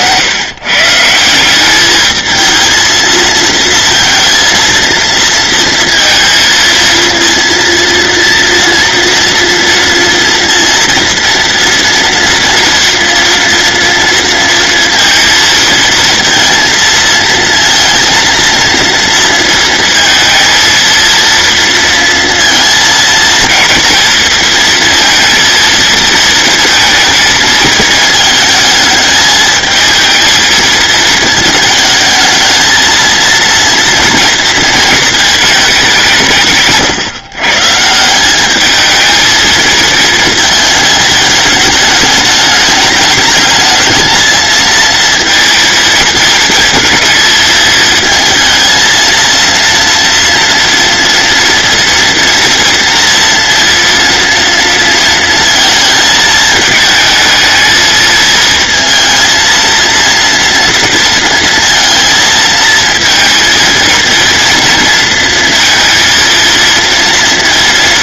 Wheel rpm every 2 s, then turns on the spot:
140, 230, 230, 230, 230, 230, 230, 230, 230, 230, 230, 230, 230, 220, 220, 220, 220, 220, 150, 210, 220, 210, 230, 220, 230, 230, 230, 230, 220, 230, 230, 230, 230, 230.
none